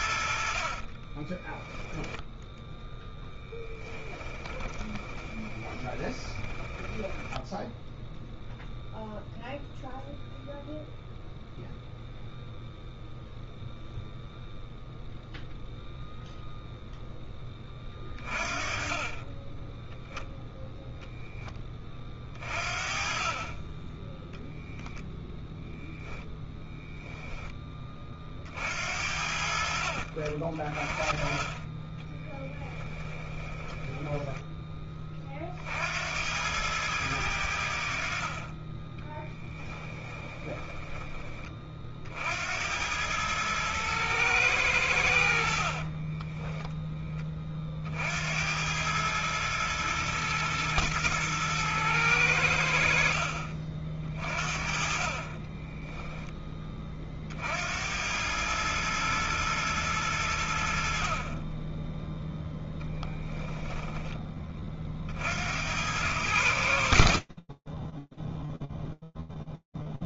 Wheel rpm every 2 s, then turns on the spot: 20, 10, 20, 10, 0, 0, 0, 0, 10, 30, 0, 40, 10, 10, 60, 30, 10, 30, 100, 20, 20, 100, 70, 20, 100, 110, 60, 30, 40, 110, 40, 10, 60, 20, 0.
0-8 32-34 38-40 54-56